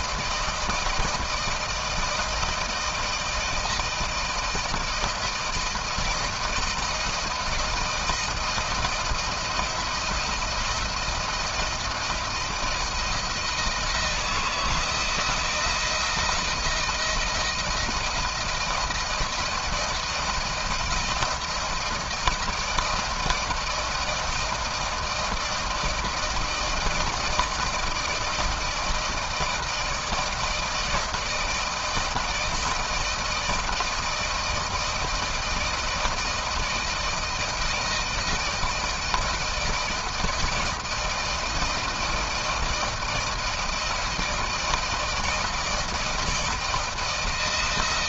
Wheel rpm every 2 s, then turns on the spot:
160, 160, 160, 170, 170, 170, 170, 170, 170, 170, 170, 160, 160, 160, 160, 160, 160, 160, 160, 160, 160, 160, 160, 160.
none